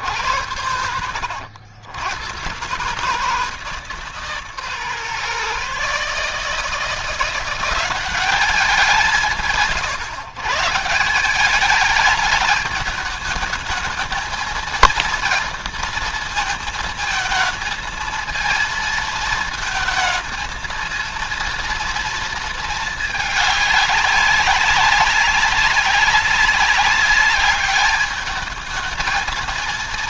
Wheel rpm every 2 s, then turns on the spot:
80, 130, 140, 160, 180, 160, 210, 230, 220, 220, 230, 220, 190, 200, 220.
none